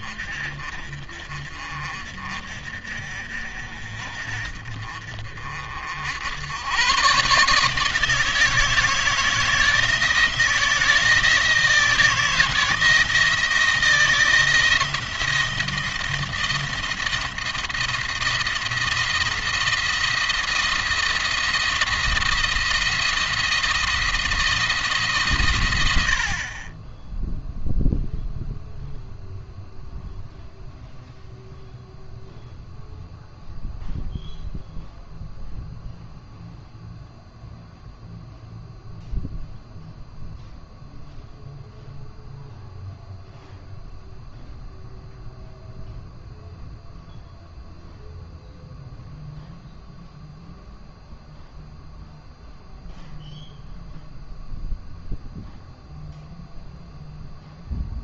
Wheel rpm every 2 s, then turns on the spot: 40, 50, 40, 110, 160, 160, 160, 170, 170, 170, 170, 170, 160, 20, 0, 0, 0, 0, 0, 0, 0, 0, 0, 0, 0, 0, 0, 0, 0.
none